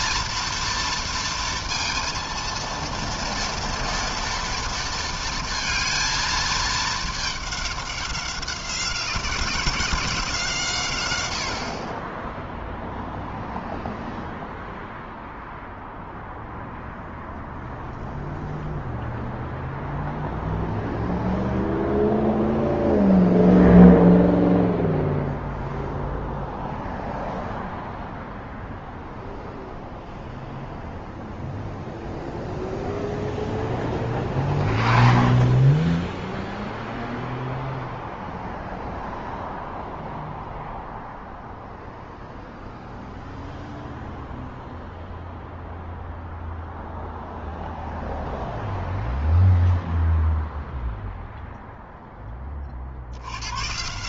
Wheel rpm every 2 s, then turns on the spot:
230, 230, 230, 210, 190, 80, 0, 0, 0, 0, 0, 0, 0, 0, 0, 0, 0, 0, 0, 0, 0, 0, 0, 0, 0, 0, 90.
none